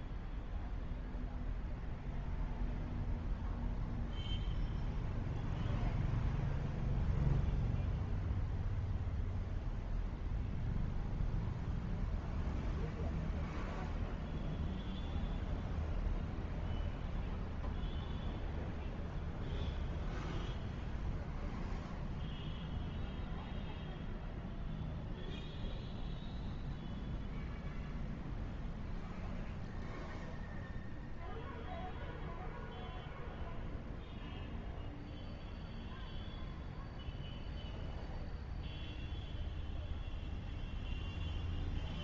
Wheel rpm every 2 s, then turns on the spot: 0, 0, 0, 0, 0, 0, 0, 0, 0, 0, 0, 0, 0, 0, 0, 0, 0, 0, 0, 0, 0.
none